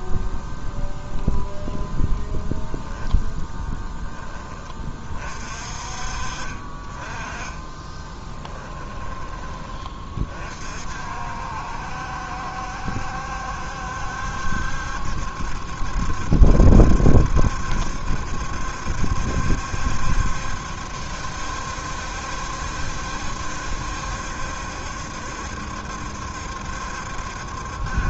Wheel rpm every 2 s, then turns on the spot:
0, 0, 30, 20, 10, 50, 70, 70, 70, 70, 70, 70, 70, 70.
8-10